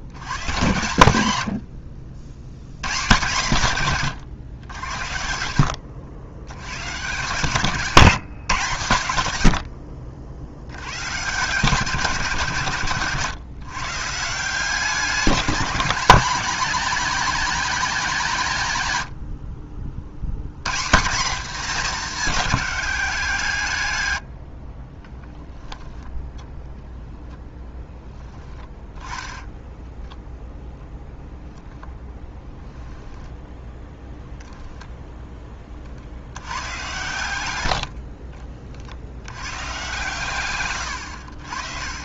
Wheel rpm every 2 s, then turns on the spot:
90, 130, 70, 130, 120, 90, 130, 180, 220, 100, 170, 190, 30, 0, 10, 0, 10, 10, 110, 70, 100.
24-26 28-30